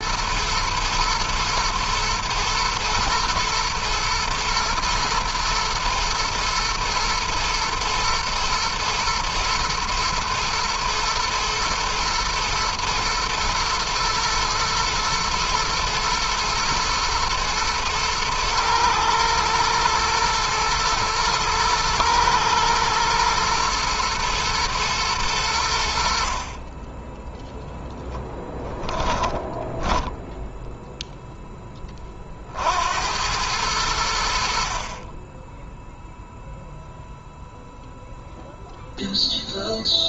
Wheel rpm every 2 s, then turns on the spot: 110, 110, 110, 120, 120, 110, 120, 120, 110, 110, 110, 110, 110, 20, 10, 0, 70, 40, 0, 0.
28-30